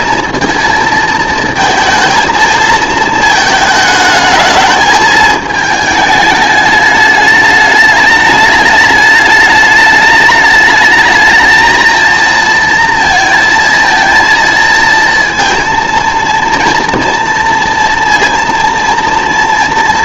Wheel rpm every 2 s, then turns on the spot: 230, 220, 220, 210, 210, 220, 230, 230, 230, 230.
none